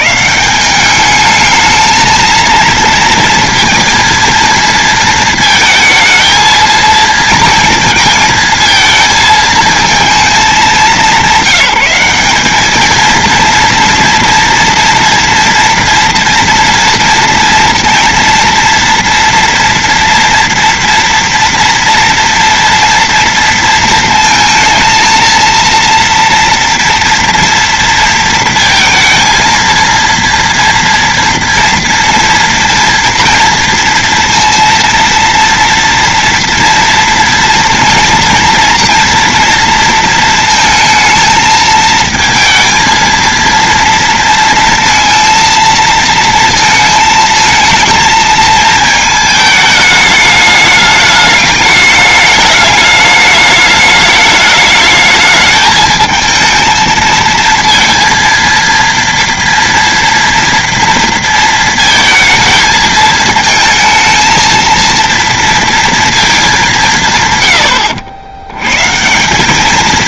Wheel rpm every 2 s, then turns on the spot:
110, 220, 230, 230, 230, 220, 210, 230, 230, 230, 230, 230, 220, 230, 230, 230, 230, 230, 230, 230, 230, 220, 230, 230, 220, 210, 210, 210, 220, 230, 230, 230, 220, 220, 80.
none